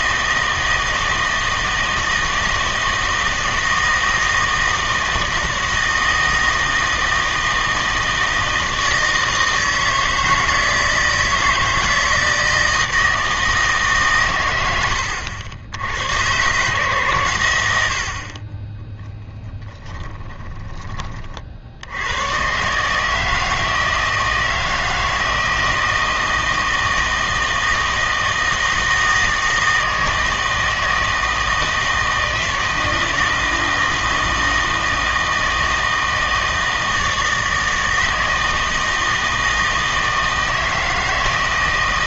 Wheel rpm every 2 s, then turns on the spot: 160, 160, 160, 160, 160, 160, 160, 100, 130, 20, 10, 130, 160, 160, 160, 160, 160, 160, 160, 160, 160.
20-22